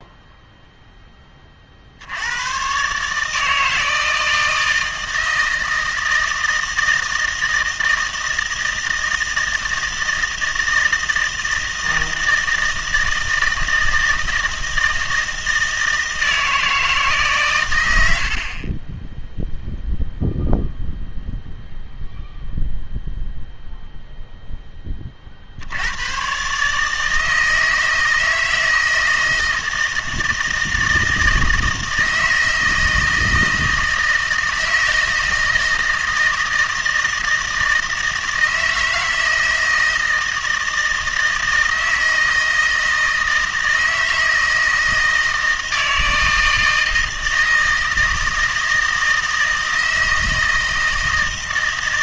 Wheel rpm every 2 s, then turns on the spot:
0, 120, 160, 160, 160, 160, 160, 160, 160, 30, 0, 0, 10, 150, 160, 160, 160, 160, 160, 160, 160, 160, 160, 160, 160, 160.
none